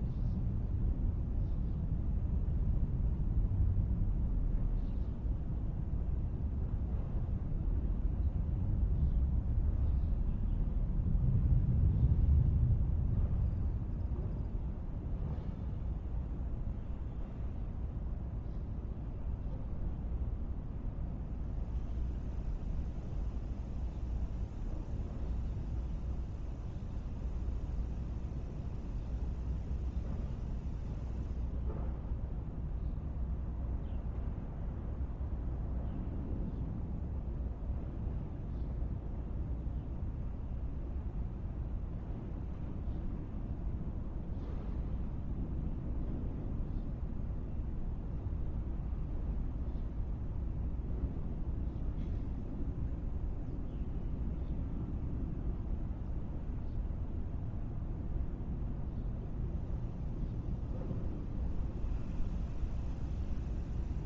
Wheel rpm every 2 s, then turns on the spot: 0, 0, 0, 0, 0, 0, 0, 0, 0, 0, 0, 0, 0, 0, 0, 0, 0, 0, 0, 0, 0, 0, 0, 0, 0, 0, 0, 0, 0, 0, 0, 0.
none